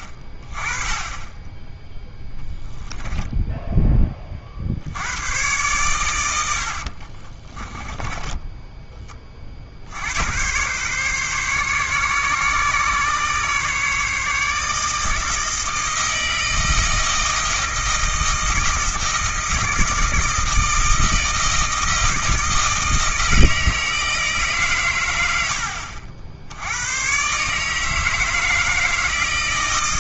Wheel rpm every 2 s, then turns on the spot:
20, 0, 60, 70, 10, 120, 140, 150, 160, 160, 160, 160, 130, 90, 160.
none